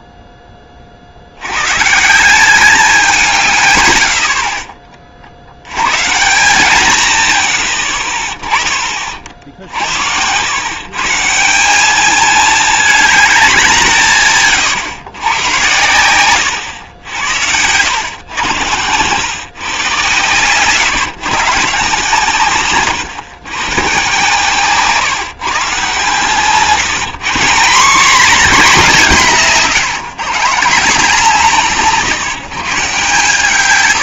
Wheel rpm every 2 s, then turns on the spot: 20, 180, 20, 140, 30, 120, 210, 120, 100, 100, 120, 130, 140, 160, 230, 160, 160.
none